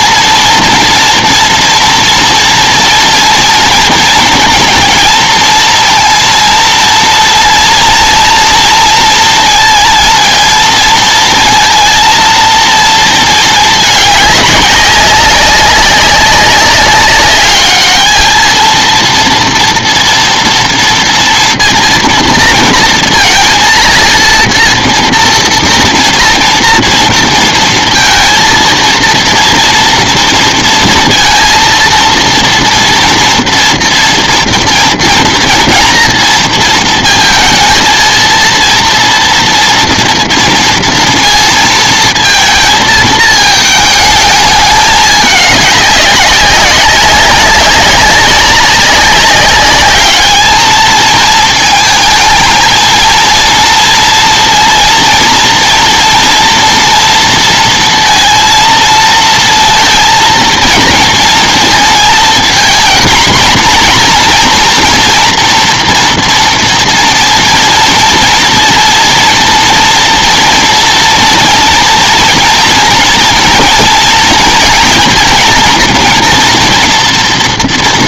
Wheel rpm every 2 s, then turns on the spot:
230, 240, 230, 230, 230, 230, 220, 200, 210, 230, 230, 230, 230, 230, 230, 230, 230, 230, 230, 230, 230, 220, 200, 190, 200, 220, 230, 230, 230, 230, 230, 230, 240, 230, 230, 230, 230, 230, 230.
none